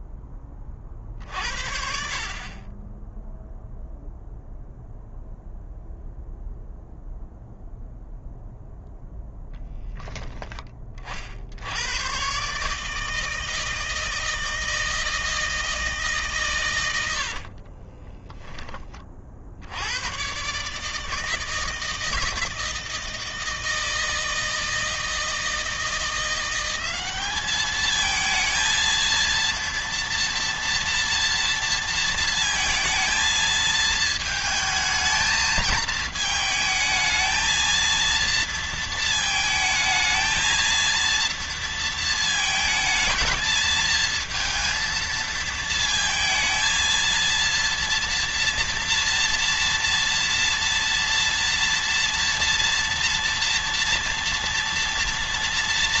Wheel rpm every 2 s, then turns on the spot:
30, 20, 0, 0, 0, 30, 150, 160, 110, 20, 150, 160, 160, 200, 230, 240, 220, 220, 220, 230, 230, 220, 220, 220, 230, 230, 230, 230.
none